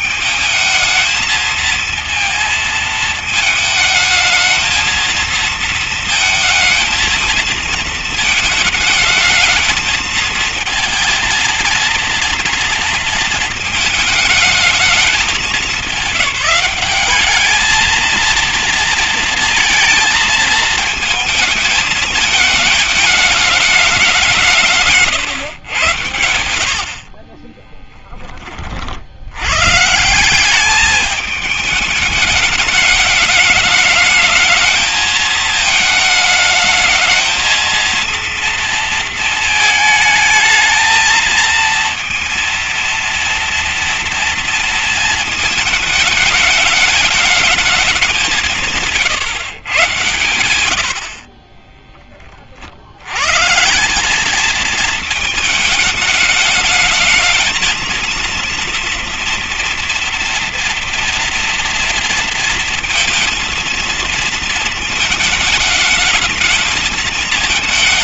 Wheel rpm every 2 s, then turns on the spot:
220, 230, 220, 220, 220, 230, 220, 210, 200, 230, 220, 210, 150, 70, 60, 200, 210, 220, 220, 230, 230, 230, 230, 210, 160, 90, 60, 220, 220, 230, 230, 230, 220, 220.
50-52